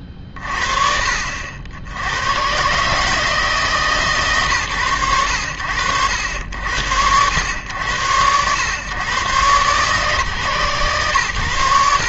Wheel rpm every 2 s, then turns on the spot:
20, 120, 100, 80, 120, 120.
none